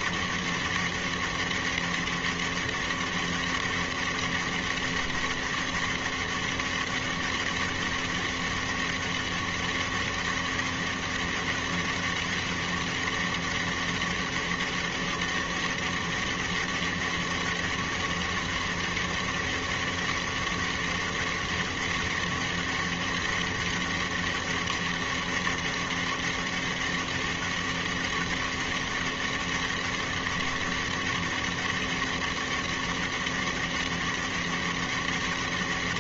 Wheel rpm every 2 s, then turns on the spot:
200, 200, 200, 200, 200, 200, 200, 200, 200, 200, 200, 200, 200, 200, 200, 200, 200, 200.
none